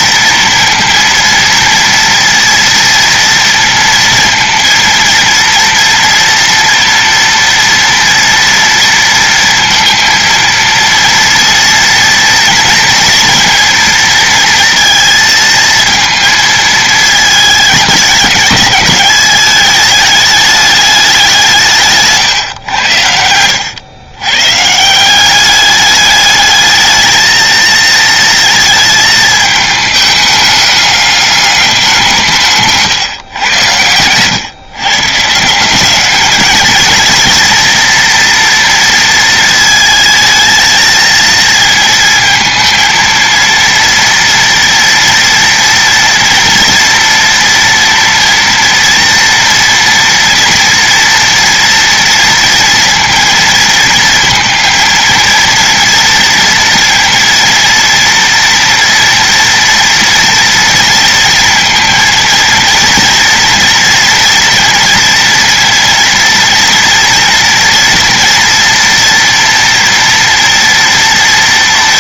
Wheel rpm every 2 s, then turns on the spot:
230, 230, 230, 230, 230, 230, 230, 230, 220, 200, 210, 100, 160, 220, 220, 200, 140, 140, 220, 230, 220, 230, 230, 230, 230, 230, 230, 230, 230, 230, 230, 230, 230, 230, 240, 230.
none